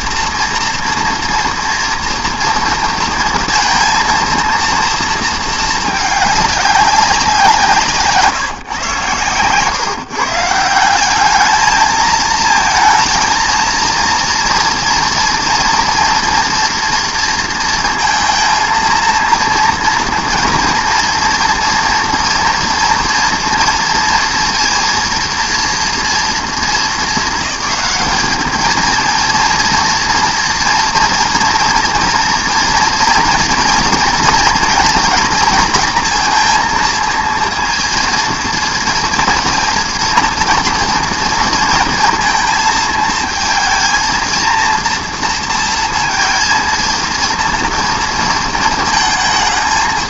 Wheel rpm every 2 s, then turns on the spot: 230, 230, 230, 200, 140, 170, 220, 240, 230, 230, 230, 240, 230, 220, 220, 230, 230, 230, 230, 230, 230, 220, 230, 230, 220.
none